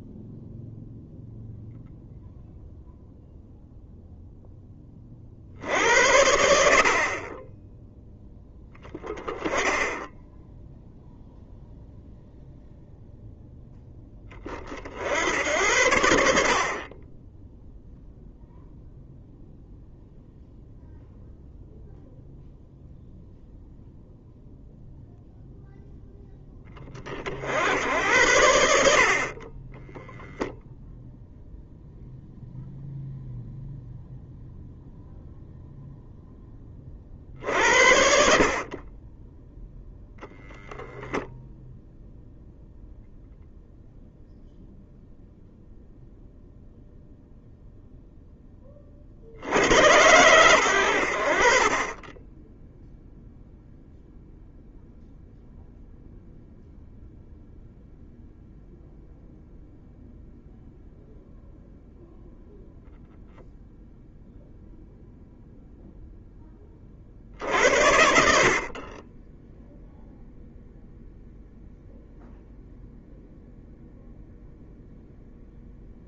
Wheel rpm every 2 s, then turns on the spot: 0, 0, 10, 50, 10, 0, 0, 50, 30, 0, 0, 0, 0, 20, 60, 0, 0, 0, 40, 30, 10, 0, 0, 0, 50, 80, 0, 0, 0, 0, 0, 0, 0, 30, 30, 0, 0, 0.
none